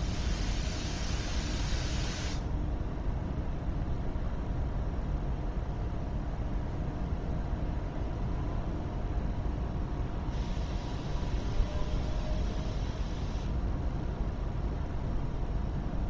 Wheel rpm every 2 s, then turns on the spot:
0, 0, 0, 0, 0, 0, 0, 0.
none